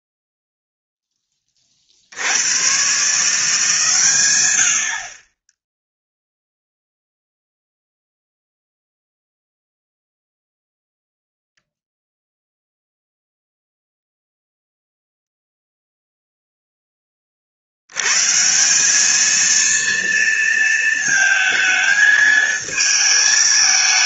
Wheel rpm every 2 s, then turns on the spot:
0, 90, 90, 0, 0, 0, 0, 0, 0, 160, 230, 220.
none